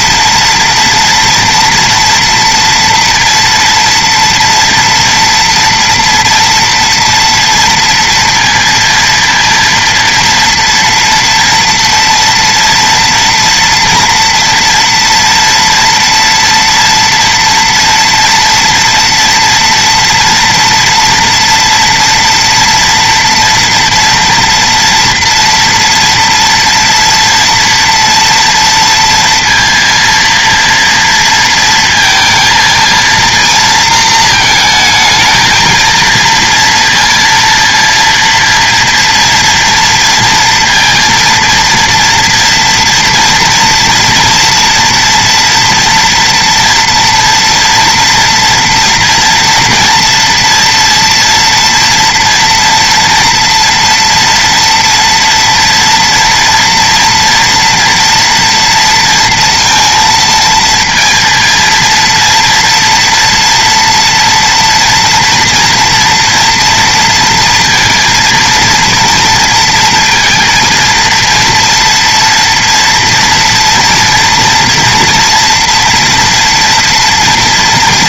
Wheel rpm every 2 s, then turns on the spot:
230, 230, 230, 240, 230, 240, 230, 230, 230, 230, 230, 230, 230, 230, 230, 230, 230, 220, 230, 230, 230, 230, 230, 230, 230, 240, 240, 240, 230, 230, 230, 230, 230, 230, 230, 230, 230, 230, 230.
none